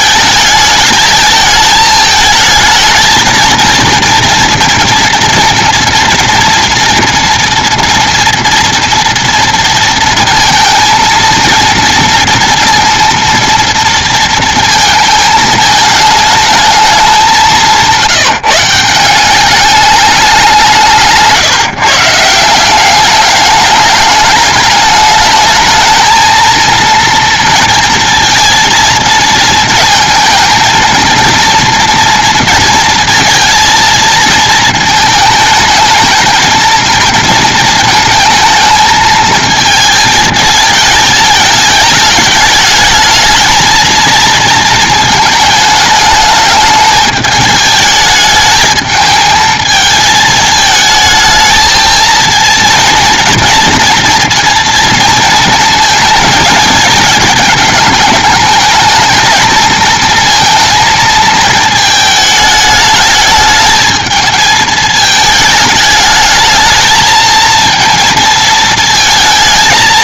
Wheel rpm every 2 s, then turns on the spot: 220, 230, 230, 240, 240, 230, 230, 220, 210, 170, 170, 190, 210, 230, 230, 230, 230, 220, 220, 220, 210, 210, 220, 210, 220, 220, 230, 230, 220, 220, 230, 210, 210, 220, 230.
none